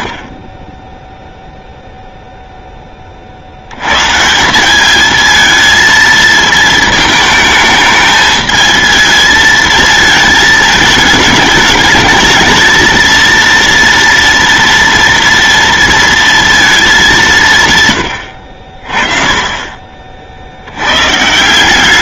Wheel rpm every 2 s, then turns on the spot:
0, 10, 190, 220, 220, 220, 220, 230, 220, 60, 110.
none